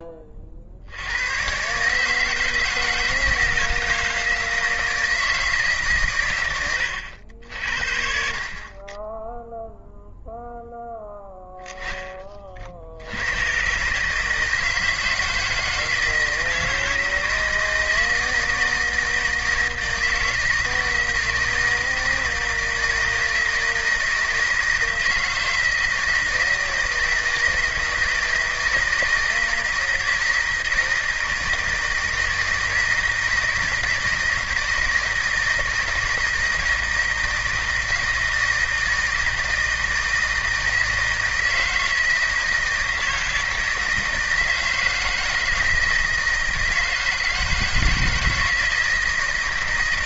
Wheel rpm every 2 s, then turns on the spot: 70, 160, 160, 100, 20, 0, 60, 160, 160, 160, 160, 160, 160, 160, 160, 160, 160, 160, 160, 160, 160, 160, 160, 160, 160.
6-8